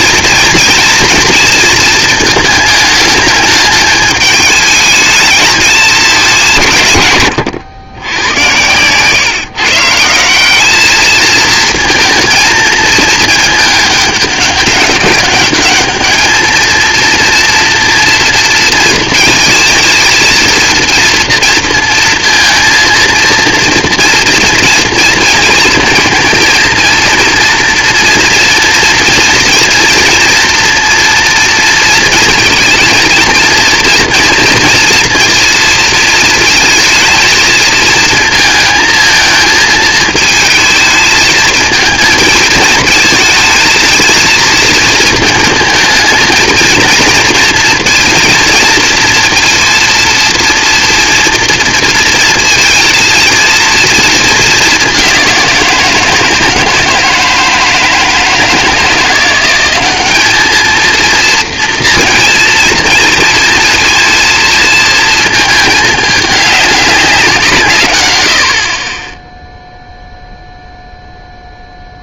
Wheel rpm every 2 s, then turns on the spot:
230, 220, 210, 160, 110, 190, 220, 200, 220, 230, 230, 230, 230, 230, 230, 230, 230, 240, 230, 220, 230, 220, 220, 230, 230, 230, 230, 210, 160, 160, 210, 230, 230, 200, 60, 0.
8-10 68-70